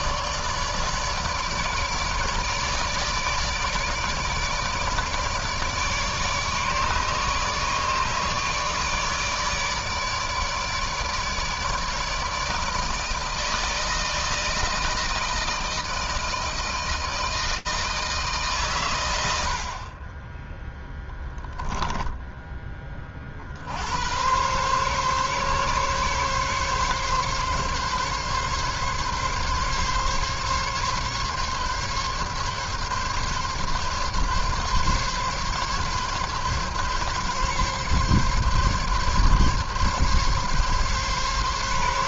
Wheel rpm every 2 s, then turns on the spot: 150, 150, 160, 150, 150, 150, 160, 160, 160, 110, 10, 40, 140, 140, 140, 140, 140, 140, 140, 140, 140.
none